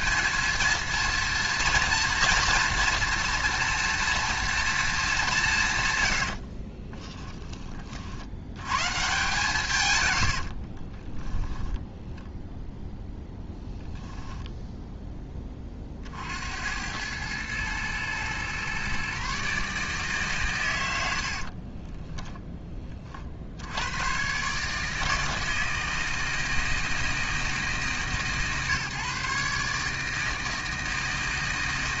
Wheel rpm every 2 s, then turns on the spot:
230, 230, 210, 20, 140, 30, 0, 10, 100, 130, 90, 30, 150, 160, 140, 160.
6-8 10-12